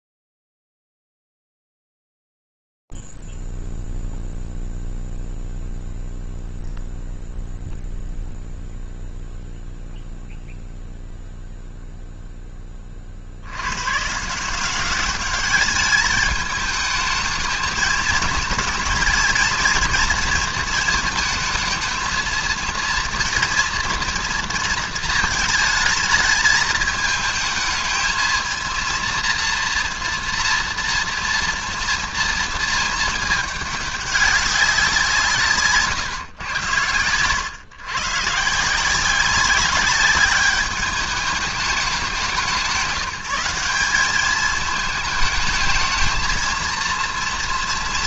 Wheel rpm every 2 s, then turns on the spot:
0, 0, 0, 0, 0, 0, 0, 150, 210, 230, 230, 230, 230, 210, 230, 230, 220, 190, 110, 170, 210, 180, 220, 230.
none